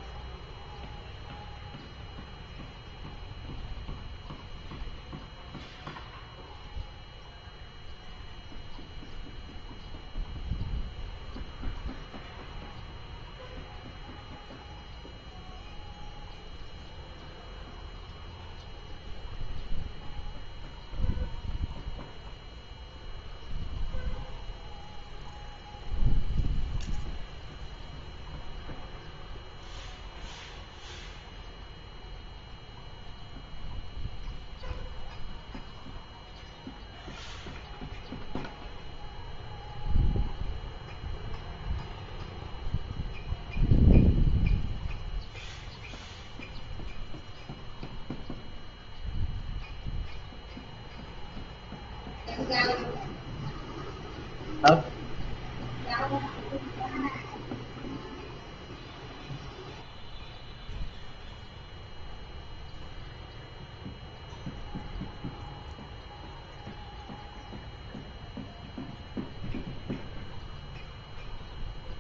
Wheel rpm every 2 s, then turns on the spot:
0, 0, 0, 0, 0, 0, 0, 0, 0, 0, 0, 0, 0, 0, 0, 0, 0, 0, 0, 0, 0, 0, 0, 0, 0, 0, 0, 0, 0, 0, 0, 0, 0, 0, 0, 0.
none